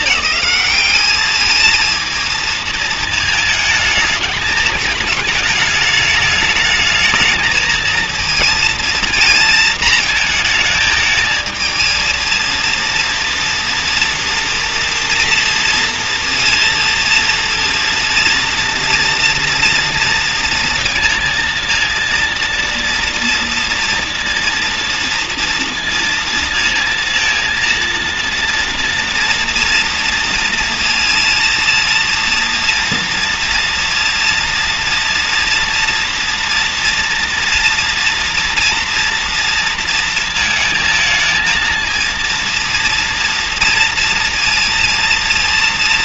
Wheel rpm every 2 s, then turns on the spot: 210, 220, 210, 210, 230, 220, 230, 230, 230, 230, 230, 230, 230, 230, 230, 230, 230, 230, 230, 230, 220, 230, 230.
none